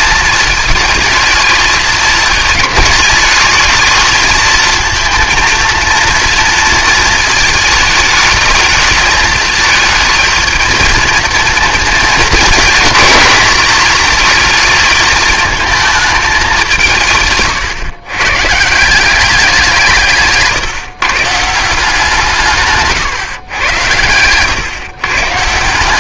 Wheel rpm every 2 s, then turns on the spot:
220, 210, 220, 230, 220, 230, 220, 220, 160, 170, 140, 140, 130.
none